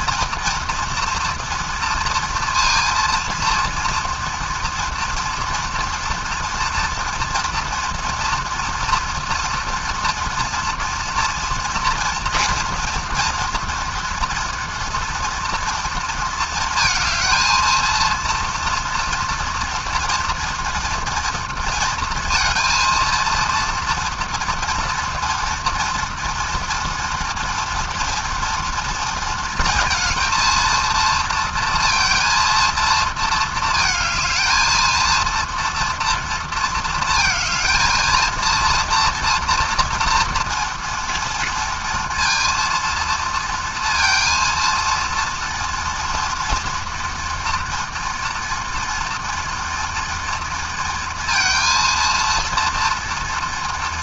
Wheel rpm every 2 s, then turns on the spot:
230, 230, 230, 230, 230, 240, 240, 230, 230, 240, 230, 230, 240, 230, 230, 230, 230, 230, 230, 230, 230, 230, 230, 230, 230, 230, 230.
none